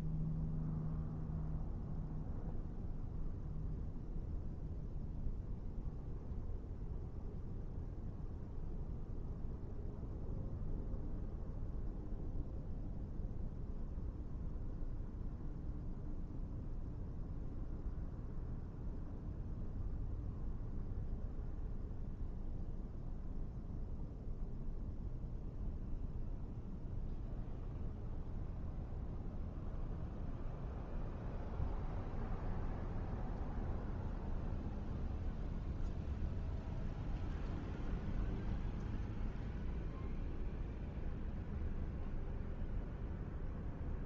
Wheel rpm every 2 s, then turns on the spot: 0, 0, 0, 0, 0, 0, 0, 0, 0, 0, 0, 0, 0, 0, 0, 0, 0, 0, 0, 0, 0, 0.
none